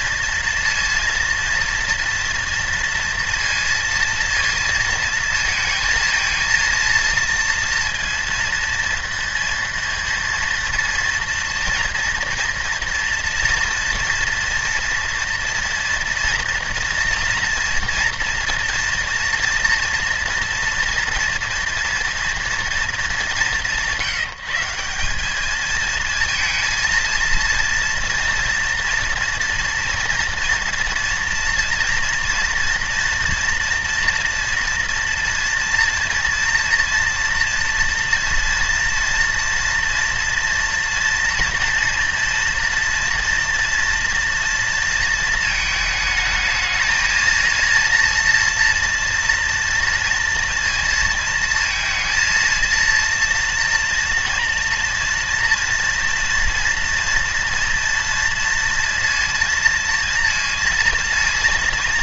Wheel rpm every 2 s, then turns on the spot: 230, 230, 230, 230, 230, 230, 230, 230, 230, 230, 230, 220, 180, 230, 240, 240, 230, 240, 230, 230, 230, 230, 230, 220, 230, 230, 230, 240, 230, 230, 230.
none